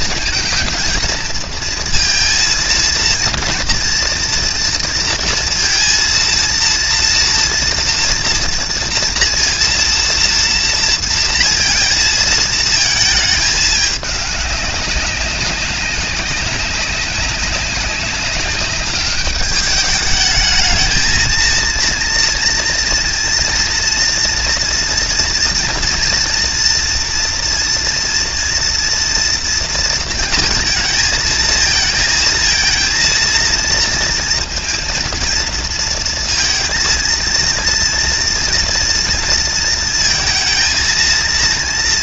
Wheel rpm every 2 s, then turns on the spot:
230, 230, 230, 230, 240, 230, 220, 200, 200, 200, 220, 230, 230, 230, 230, 230, 230, 230, 230, 240, 230.
none